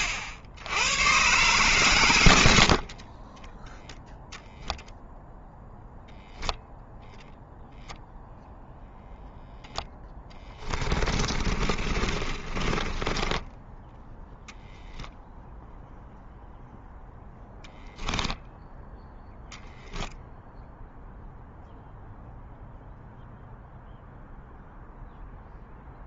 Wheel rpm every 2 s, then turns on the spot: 80, 80, 0, 0, 0, 20, 20, 0, 0, 10, 0, 0, 0.
2-4 10-14